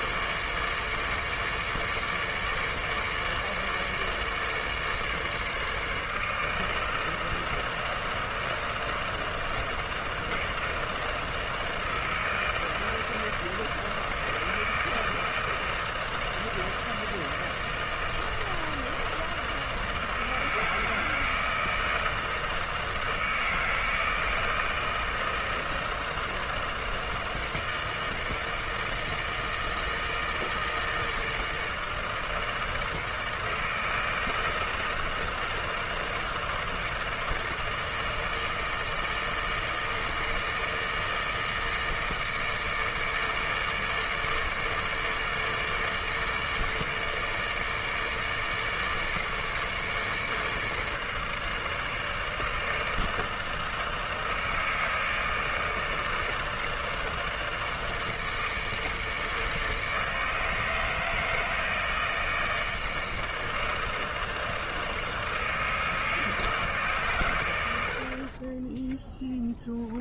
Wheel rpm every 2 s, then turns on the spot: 150, 150, 150, 160, 160, 160, 160, 160, 160, 160, 160, 160, 160, 160, 160, 160, 160, 160, 160, 160, 160, 160, 150, 150, 150, 150, 160, 160, 150, 150, 160, 160, 160, 140, 10.
none